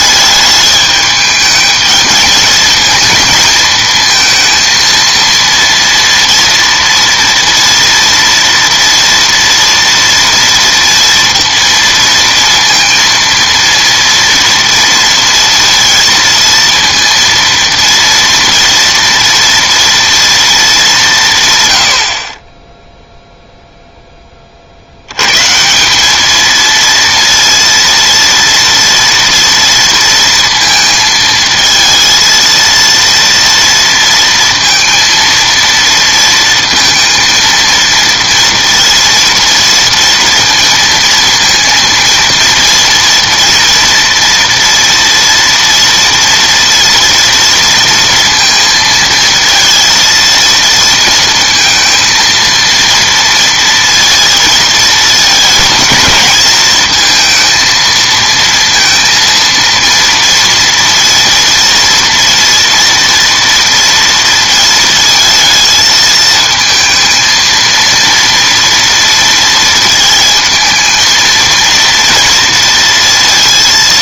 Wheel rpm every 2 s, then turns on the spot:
210, 220, 230, 230, 230, 230, 230, 230, 230, 230, 220, 10, 50, 230, 230, 230, 230, 230, 230, 230, 230, 230, 230, 230, 230, 230, 230, 230, 230, 230, 230, 230, 230, 230, 230, 220, 230.
none